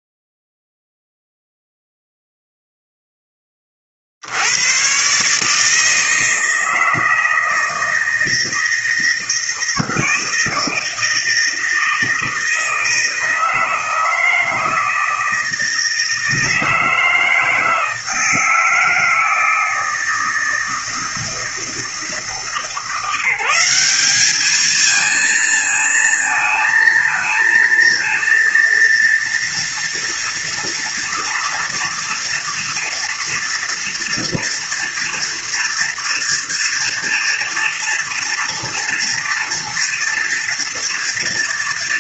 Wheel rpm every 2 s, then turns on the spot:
0, 0, 90, 160, 160, 160, 160, 160, 160, 160, 160, 160, 210, 220, 230, 240, 230, 230, 230, 230, 230.
none